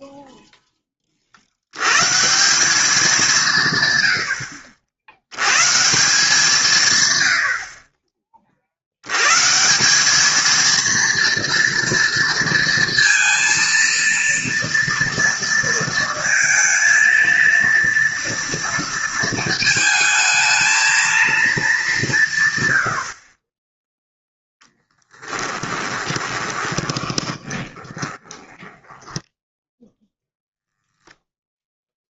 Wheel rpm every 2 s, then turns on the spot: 20, 170, 120, 90, 130, 230, 230, 230, 230, 220, 220, 20, 10, 20, 10, 0.
24-30